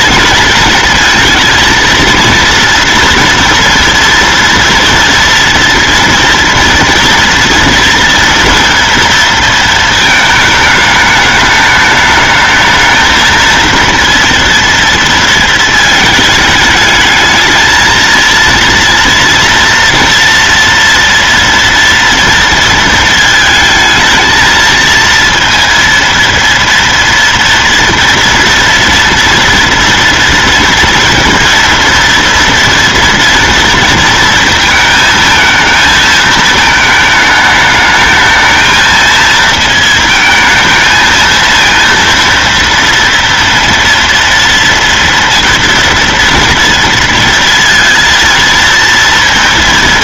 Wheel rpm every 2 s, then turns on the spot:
230, 230, 230, 230, 230, 220, 220, 230, 220, 230, 230, 230, 230, 230, 230, 230, 230, 220, 220, 220, 220, 230, 230, 230, 230.
none